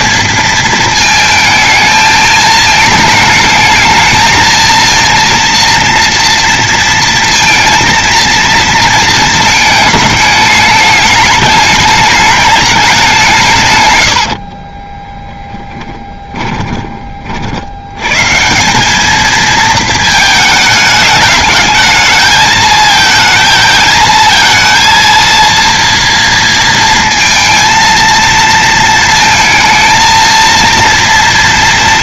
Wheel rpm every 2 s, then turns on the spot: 230, 220, 220, 230, 230, 210, 210, 50, 20, 170, 220, 220, 230, 230, 230, 230.
14-18